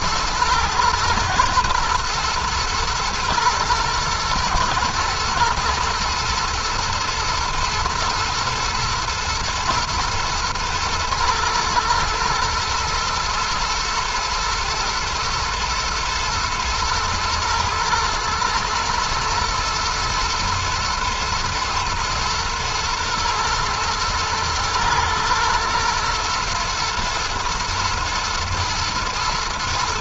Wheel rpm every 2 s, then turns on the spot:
110, 120, 120, 120, 120, 120, 120, 120, 120, 110, 120, 110, 110, 110, 110.
none